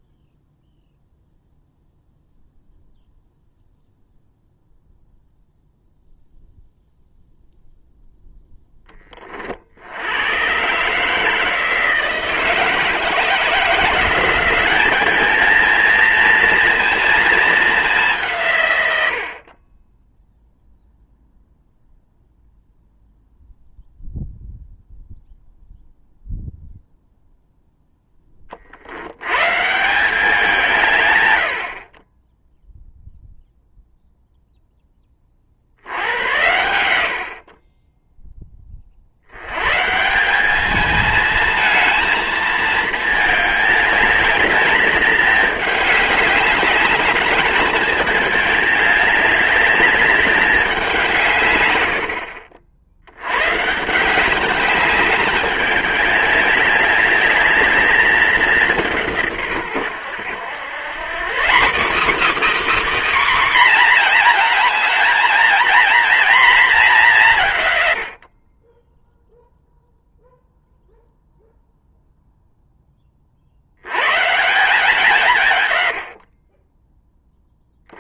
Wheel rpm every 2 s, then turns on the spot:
0, 0, 0, 0, 20, 150, 160, 210, 230, 80, 0, 0, 0, 0, 80, 140, 0, 20, 80, 60, 220, 220, 210, 210, 210, 170, 80, 200, 200, 170, 150, 290, 220, 180, 0, 0, 20, 160, 20.
none